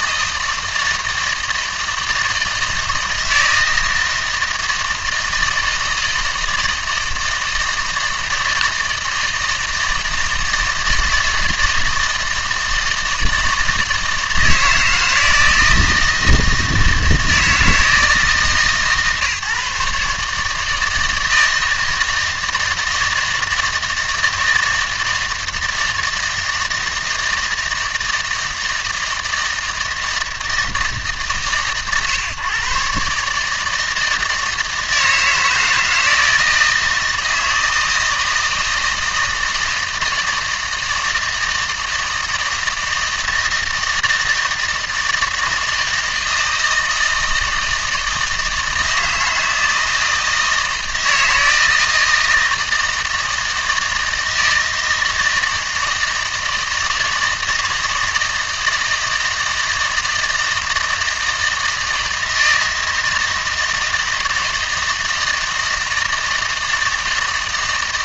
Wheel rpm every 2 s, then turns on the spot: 160, 160, 160, 160, 160, 160, 160, 160, 160, 150, 160, 160, 160, 160, 160, 150, 140, 160, 160, 160, 160, 160, 160, 160, 160, 160, 160, 160, 160, 160, 160, 160, 160, 160.
none